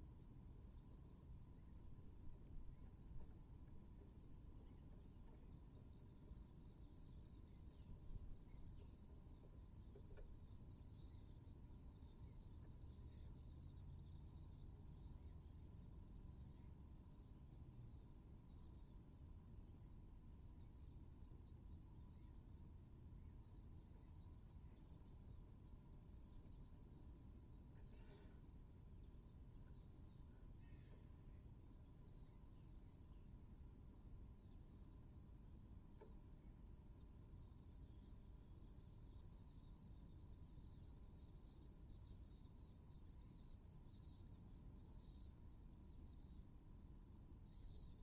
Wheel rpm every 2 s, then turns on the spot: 0, 0, 0, 0, 0, 0, 0, 0, 0, 0, 0, 0, 0, 0, 0, 0, 0, 0, 0, 0, 0, 0, 0, 0.
none